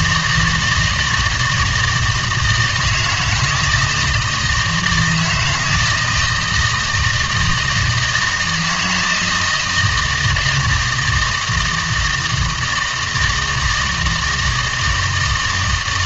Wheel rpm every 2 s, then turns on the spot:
160, 160, 160, 160, 160, 160, 160, 170.
none